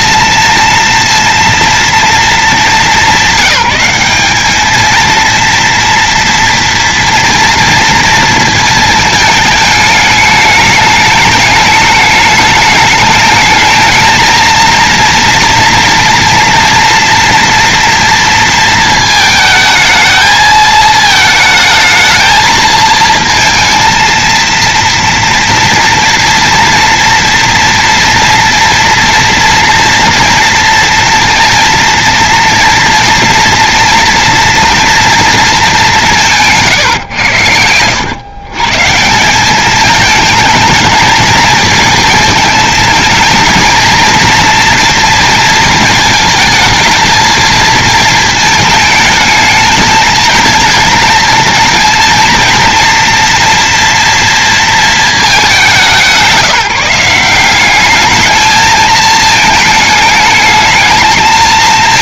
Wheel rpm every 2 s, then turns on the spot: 230, 210, 210, 230, 230, 210, 210, 230, 230, 230, 220, 220, 230, 230, 230, 230, 230, 240, 150, 140, 220, 220, 230, 220, 220, 220, 230, 230, 180, 220, 220.
36-38